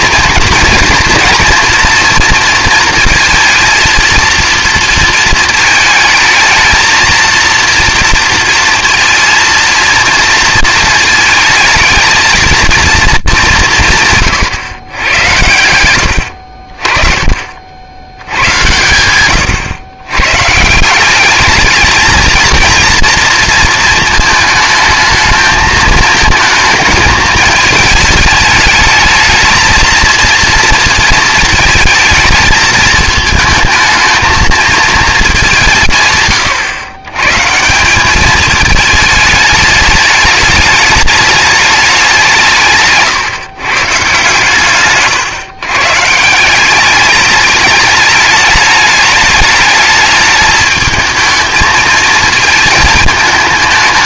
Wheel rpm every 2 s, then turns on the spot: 230, 230, 230, 220, 230, 230, 230, 130, 50, 90, 150, 230, 220, 220, 210, 230, 220, 220, 130, 220, 210, 180, 140, 180, 210, 220, 220.
none